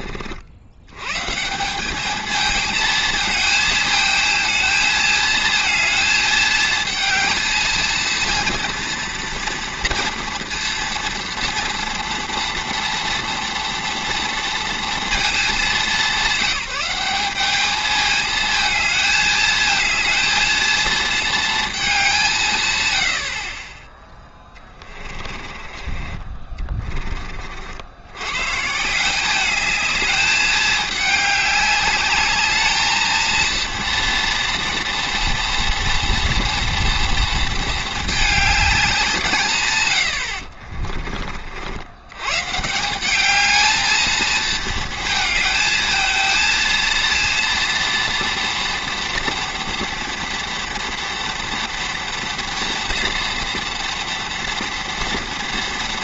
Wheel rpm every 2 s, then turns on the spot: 80, 220, 220, 220, 230, 230, 230, 230, 190, 220, 230, 140, 20, 30, 140, 210, 210, 230, 230, 200, 50, 150, 230, 230, 230, 230, 230, 230.
24-28 40-42